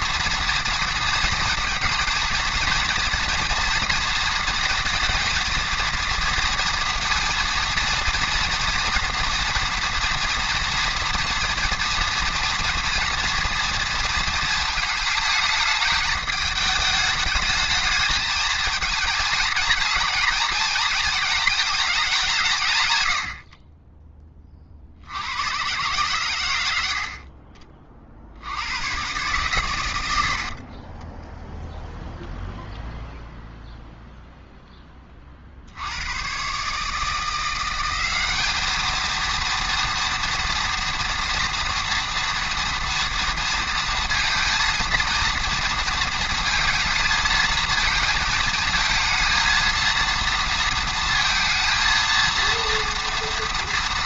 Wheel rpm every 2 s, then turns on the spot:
230, 230, 230, 230, 230, 230, 230, 220, 210, 220, 230, 140, 40, 90, 80, 50, 0, 10, 130, 210, 230, 230, 230, 220, 220, 230, 230.
30-32